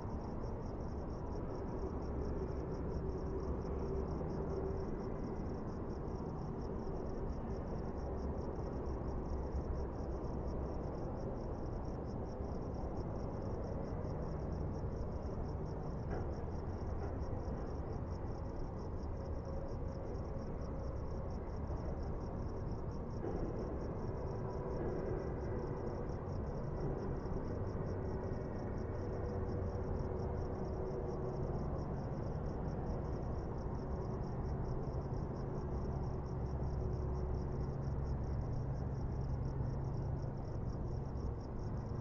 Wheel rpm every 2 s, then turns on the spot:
0, 0, 0, 0, 0, 0, 0, 0, 0, 0, 0, 0, 0, 0, 0, 0, 0, 0, 0, 0, 0.
none